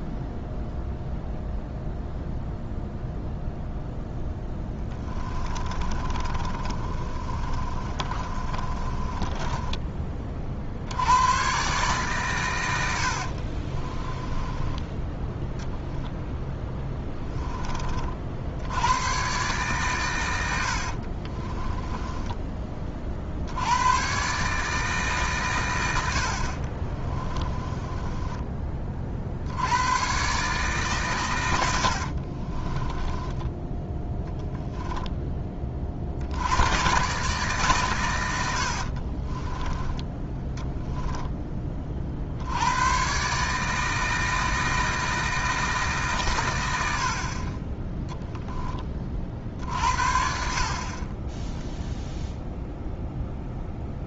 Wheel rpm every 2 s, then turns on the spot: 0, 0, 10, 30, 20, 70, 80, 10, 10, 90, 70, 30, 150, 30, 30, 140, 20, 10, 110, 60, 10, 100, 160, 90, 30, 40, 0.
4-10 14-18 20-22 26-28 32-34 38-42